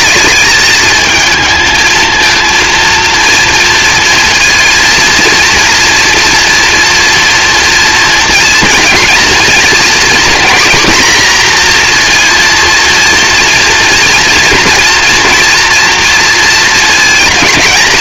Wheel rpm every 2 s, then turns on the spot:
220, 230, 230, 230, 230, 240, 230, 230, 220.
none